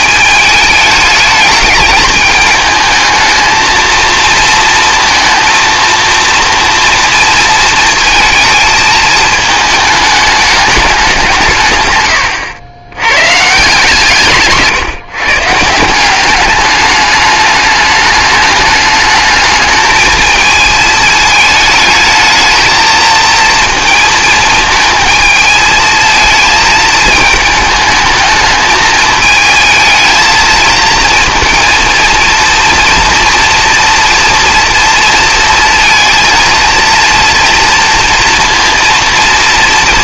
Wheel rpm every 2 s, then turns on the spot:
210, 210, 230, 230, 220, 200, 90, 150, 210, 210, 220, 220, 220, 220, 220, 220, 230, 230, 230, 230.
none